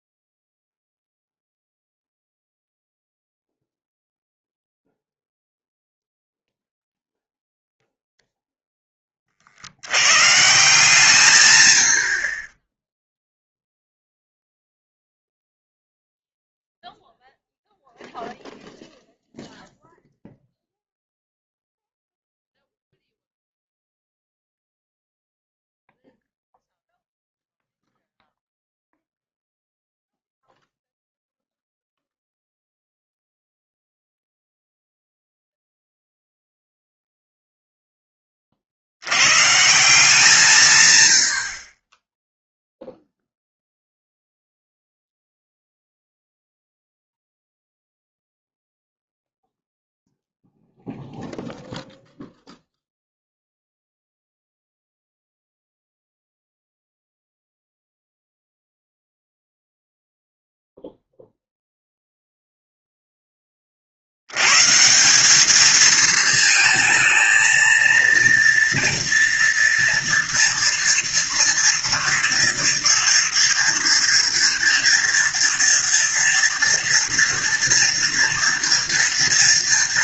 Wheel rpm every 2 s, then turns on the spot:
0, 0, 0, 0, 0, 150, 40, 0, 0, 0, 0, 0, 0, 0, 0, 0, 0, 0, 0, 50, 140, 0, 0, 0, 0, 0, 0, 0, 0, 0, 0, 0, 130, 220, 240, 230, 230, 230, 230, 230.
none